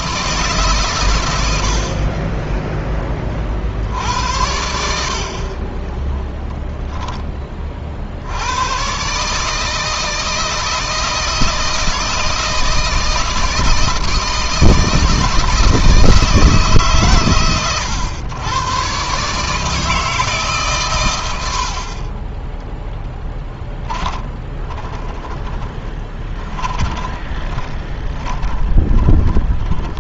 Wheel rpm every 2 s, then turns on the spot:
130, 20, 70, 10, 130, 160, 160, 160, 130, 130, 120, 20, 20, 20, 20.
22-30